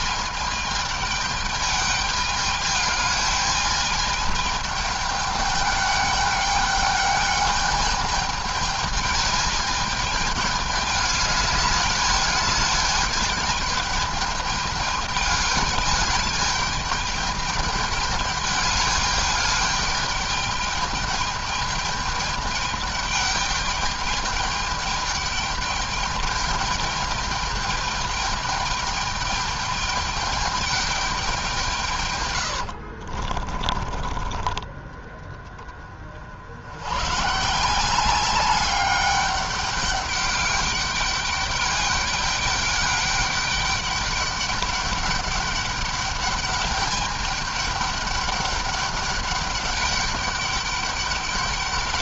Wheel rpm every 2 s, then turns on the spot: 210, 210, 210, 210, 210, 210, 210, 210, 210, 210, 210, 210, 210, 210, 210, 200, 70, 30, 110, 200, 200, 200, 200, 210, 200, 200.
32-34